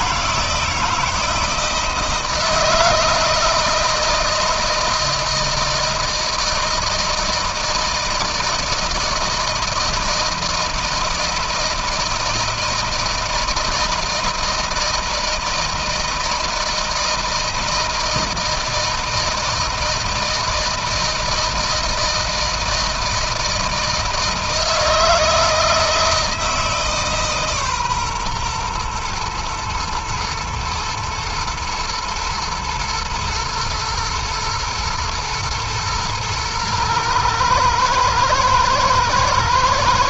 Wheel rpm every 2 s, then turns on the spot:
160, 160, 160, 160, 160, 160, 160, 160, 160, 160, 160, 160, 160, 150, 120, 110, 120, 110, 110, 120.
none